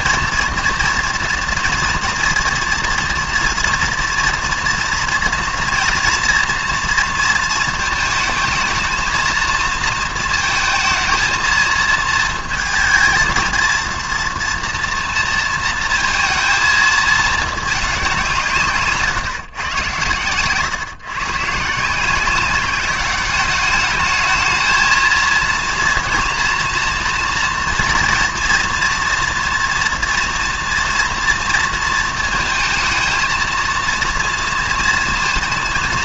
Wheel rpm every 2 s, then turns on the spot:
230, 230, 230, 230, 220, 230, 230, 230, 220, 150, 140, 200, 220, 240, 230, 230, 230, 230.
none